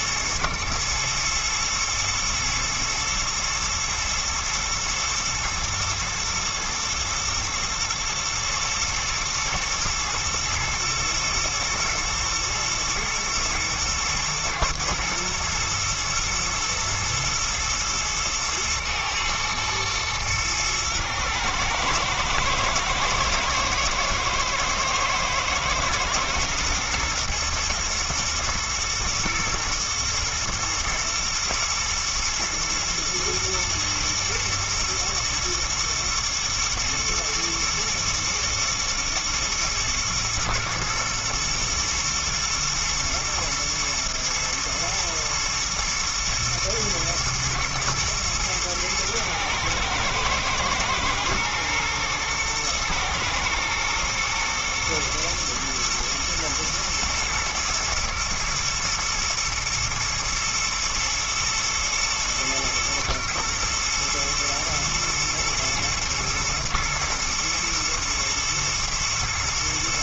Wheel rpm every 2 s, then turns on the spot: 110, 110, 110, 110, 110, 120, 110, 120, 110, 120, 110, 110, 110, 110, 110, 120, 110, 120, 110, 110, 110, 110, 110, 110, 110, 120, 120, 120, 110, 110, 110, 110, 110, 110, 120.
none